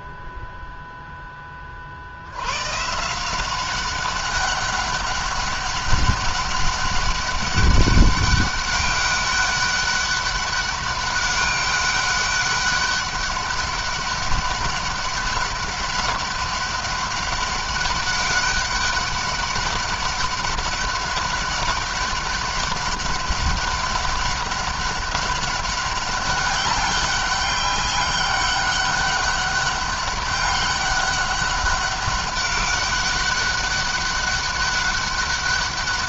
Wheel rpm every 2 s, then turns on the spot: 0, 110, 200, 200, 200, 200, 200, 200, 200, 200, 200, 200, 200, 200, 200, 200, 200, 200.
none